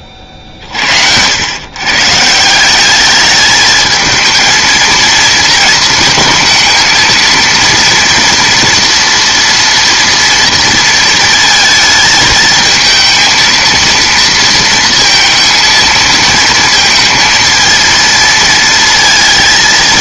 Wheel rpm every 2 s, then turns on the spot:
50, 170, 220, 220, 240, 230, 220, 230, 230, 230.
none